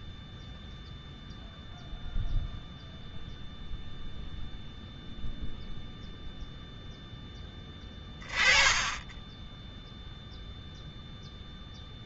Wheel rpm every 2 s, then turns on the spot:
0, 0, 0, 0, 10, 0.
8-10